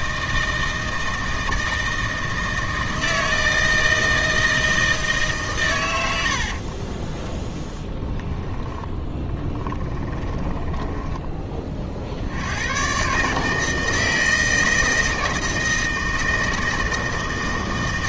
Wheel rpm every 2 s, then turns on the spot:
160, 160, 160, 50, 10, 10, 110, 160, 160.
6-12